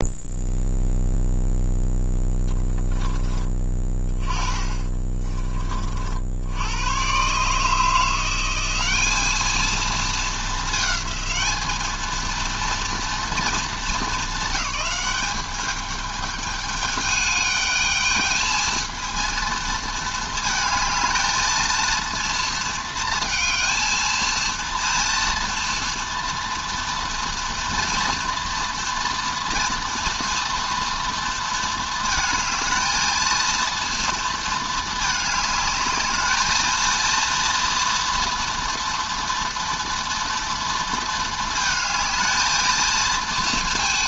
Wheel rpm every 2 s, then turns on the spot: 0, 10, 20, 90, 180, 220, 230, 210, 210, 220, 220, 230, 230, 230, 230, 230, 230, 220, 220, 230, 230, 220.
4-6